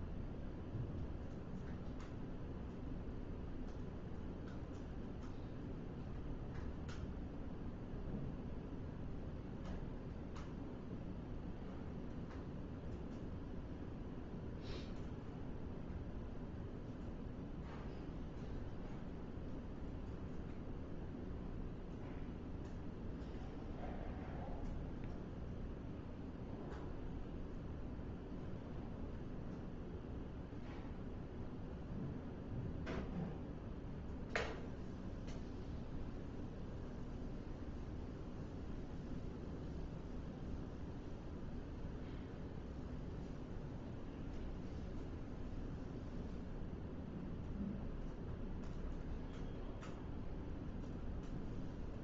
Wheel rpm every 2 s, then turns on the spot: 0, 0, 0, 0, 0, 0, 0, 0, 0, 0, 0, 0, 0, 0, 0, 0, 0, 0, 0, 0, 0, 0, 0, 0, 0, 0.
none